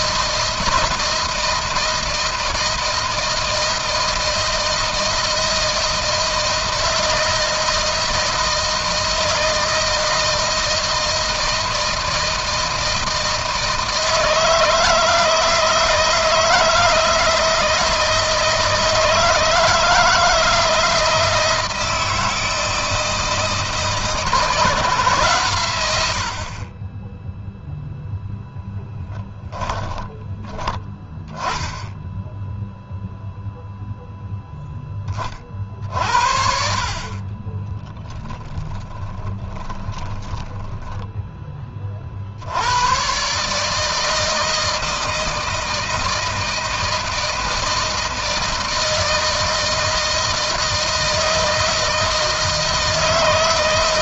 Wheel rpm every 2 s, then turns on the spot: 160, 160, 160, 160, 160, 160, 160, 160, 160, 160, 160, 160, 150, 20, 10, 10, 0, 20, 40, 20, 10, 110, 160, 160, 160, 160, 160.
28-30 36-42